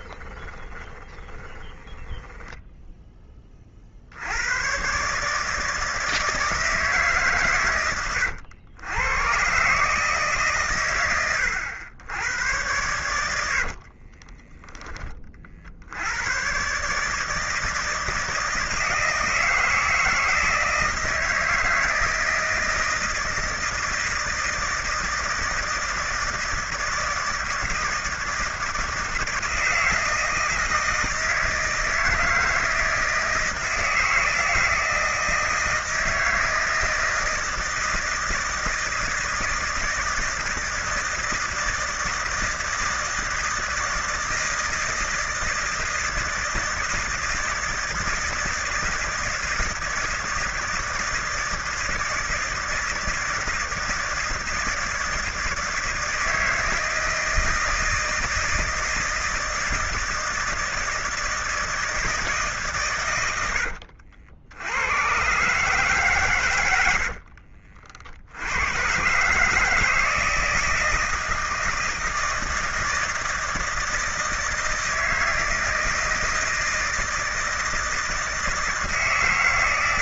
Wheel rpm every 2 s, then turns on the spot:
20, 20, 110, 160, 100, 130, 100, 20, 130, 160, 160, 160, 160, 160, 160, 160, 160, 160, 160, 160, 160, 160, 160, 160, 160, 160, 160, 160, 160, 160, 160, 150, 90, 100, 100, 160, 160, 160, 160, 160.
0-4